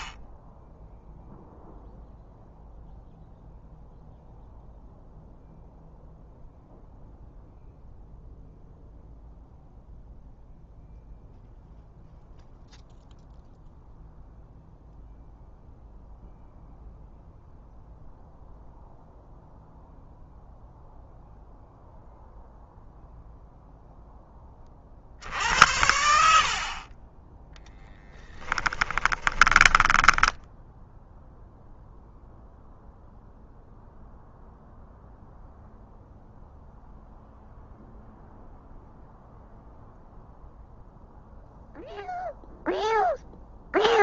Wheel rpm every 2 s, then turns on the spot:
0, 0, 0, 0, 0, 0, 0, 0, 0, 0, 0, 0, 50, 30, 10, 0, 0, 0, 0, 0, 0, 0.
28-30